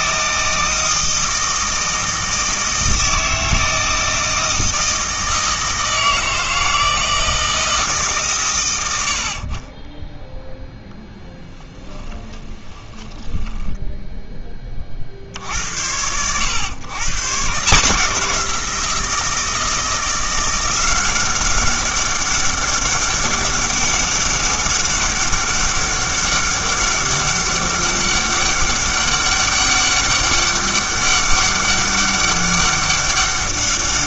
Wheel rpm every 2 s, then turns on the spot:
160, 160, 160, 160, 120, 0, 20, 40, 120, 170, 180, 200, 200, 200, 200, 200, 200.
12-14